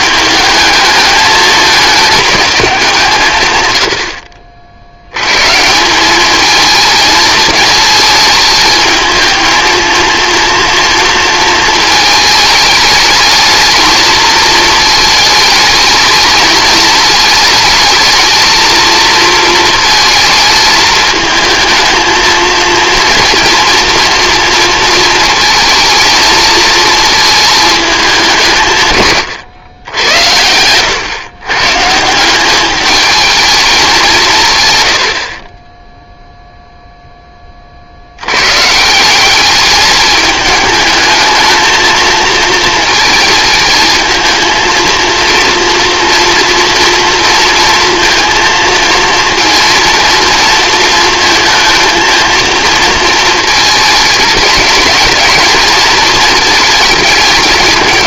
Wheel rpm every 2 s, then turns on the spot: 220, 190, 60, 220, 220, 230, 220, 220, 220, 220, 220, 230, 230, 220, 150, 100, 200, 110, 0, 140, 210, 230, 230, 240, 230, 230, 230, 210, 220.
none